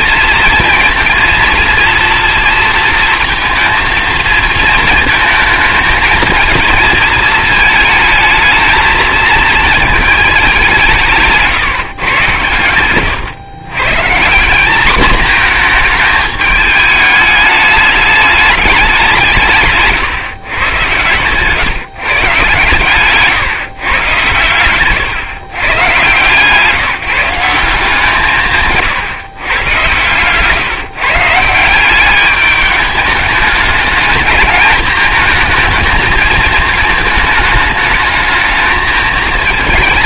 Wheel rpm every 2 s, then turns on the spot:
230, 230, 220, 220, 220, 200, 110, 200, 210, 200, 120, 140, 120, 150, 150, 140, 210, 210, 220, 220.
24-26